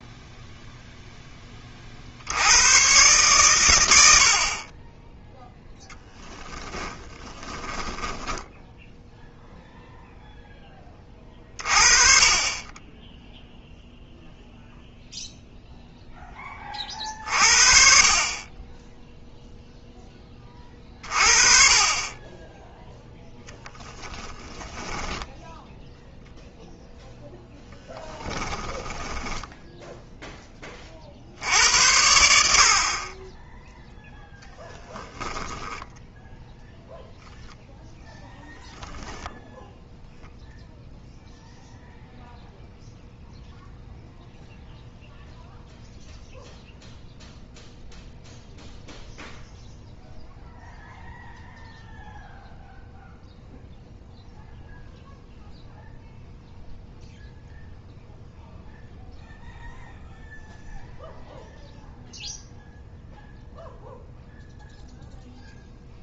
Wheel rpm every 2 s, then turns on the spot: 0, 130, 20, 10, 0, 20, 10, 0, 30, 0, 40, 0, 10, 0, 10, 50, 40, 0, 0, 10, 0, 0, 0, 0, 0, 0, 0, 0, 0, 0, 0, 0, 0.
6-8 24-26 28-30 38-40